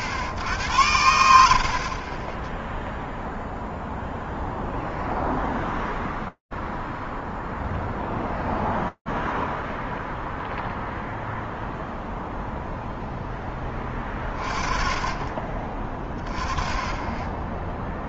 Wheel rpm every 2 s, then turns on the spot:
60, 10, 0, 0, 0, 0, 0, 30, 10.
none